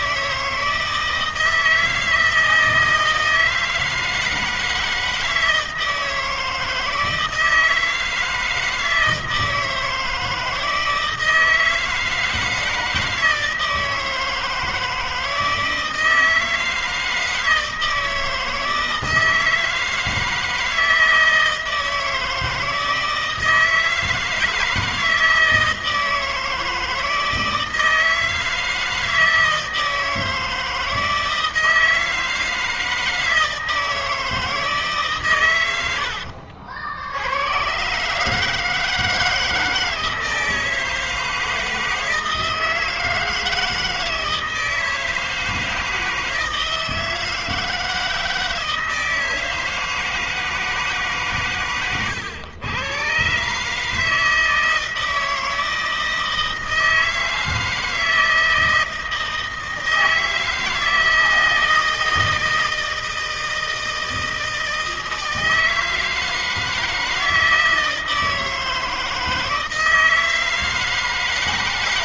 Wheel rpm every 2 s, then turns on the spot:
160, 160, 160, 160, 160, 160, 160, 160, 160, 160, 160, 160, 160, 160, 160, 160, 160, 160, 80, 150, 160, 160, 160, 160, 160, 160, 110, 160, 160, 160, 160, 160, 160, 160, 160, 160.
none